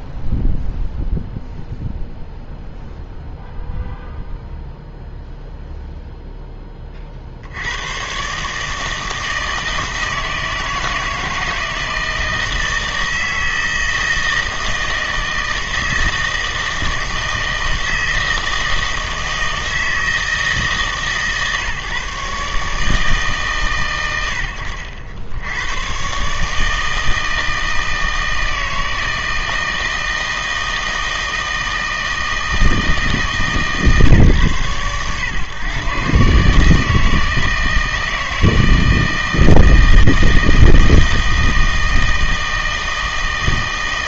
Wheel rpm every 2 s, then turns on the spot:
0, 0, 0, 10, 150, 160, 160, 160, 160, 160, 160, 150, 90, 150, 160, 160, 160, 130, 150, 160, 160, 160.
none